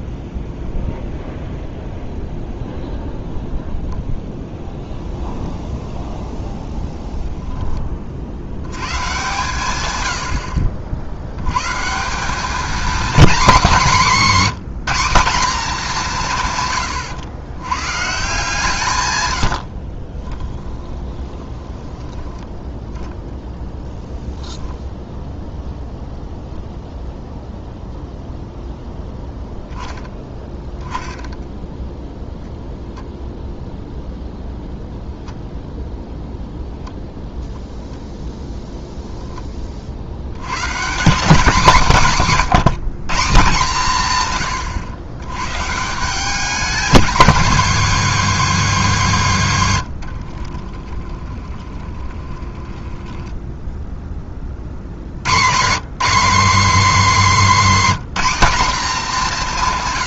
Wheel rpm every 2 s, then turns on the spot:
0, 0, 0, 0, 100, 60, 230, 200, 130, 140, 20, 10, 20, 0, 0, 20, 0, 0, 0, 0, 130, 180, 110, 230, 230, 40, 20, 50, 260, 230.
20-22 24-26 50-54